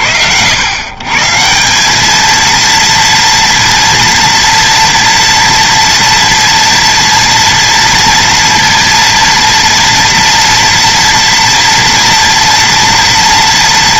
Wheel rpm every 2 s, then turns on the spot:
110, 230, 240, 230, 230, 230, 240.
none